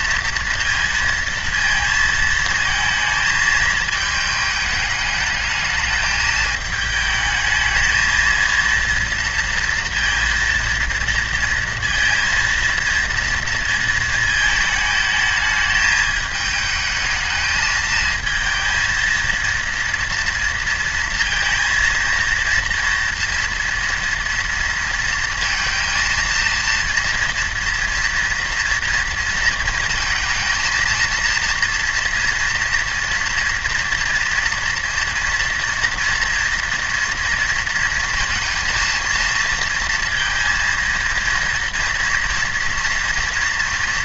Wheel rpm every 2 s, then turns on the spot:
230, 230, 220, 220, 230, 230, 230, 220, 220, 220, 230, 230, 230, 230, 230, 220, 230, 230, 230, 230, 230, 230.
none